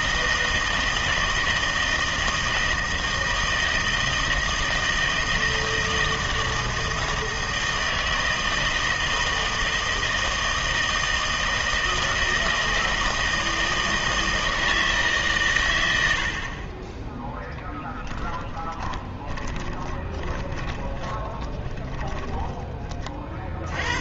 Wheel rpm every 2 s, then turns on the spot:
160, 160, 160, 160, 160, 160, 160, 160, 30, 20, 20, 30.
18-22